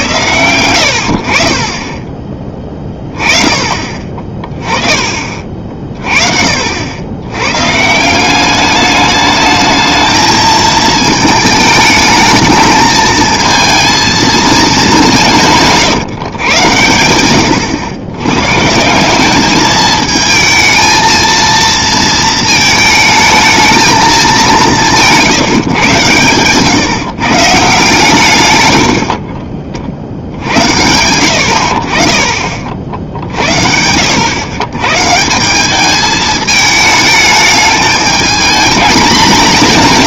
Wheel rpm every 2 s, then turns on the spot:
90, 20, 20, 60, 200, 220, 220, 210, 110, 140, 220, 220, 190, 130, 100, 80, 50, 110, 220, 220.
none